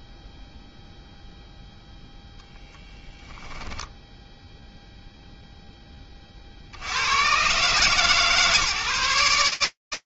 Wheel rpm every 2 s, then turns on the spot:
0, 10, 0, 60, 150.
none